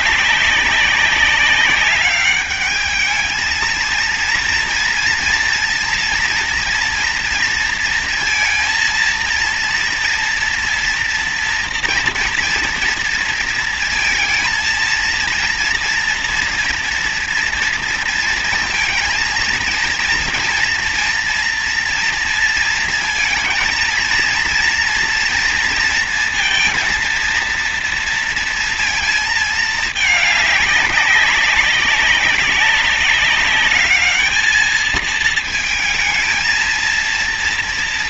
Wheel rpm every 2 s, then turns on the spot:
190, 210, 230, 230, 230, 230, 230, 230, 230, 230, 230, 230, 230, 230, 230, 200, 200, 220, 230.
none